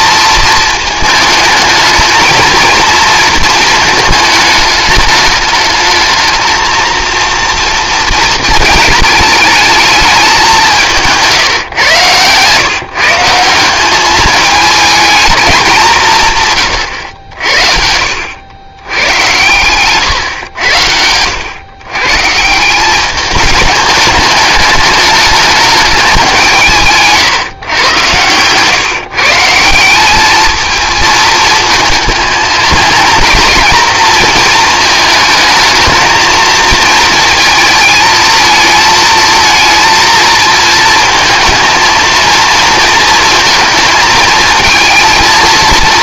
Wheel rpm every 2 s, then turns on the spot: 220, 230, 210, 230, 220, 180, 150, 220, 120, 100, 90, 180, 210, 160, 130, 220, 220, 220, 230, 220, 230, 230, 220.
none